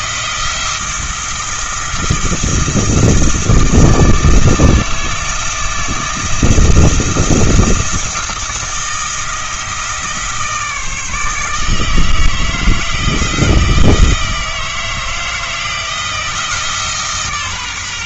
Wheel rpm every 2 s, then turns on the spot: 170, 160, 160, 160, 170, 160, 160, 160, 150.
none